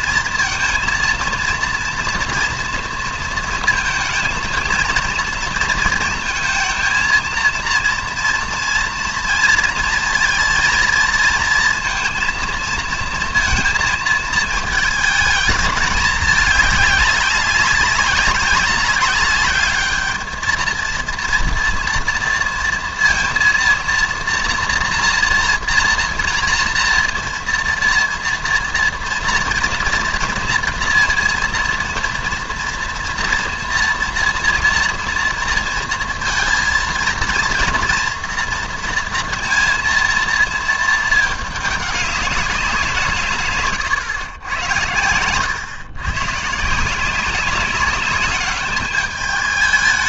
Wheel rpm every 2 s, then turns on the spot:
230, 230, 220, 230, 230, 230, 230, 220, 210, 200, 220, 230, 230, 230, 230, 230, 230, 230, 230, 230, 230, 190, 100, 140, 210.
none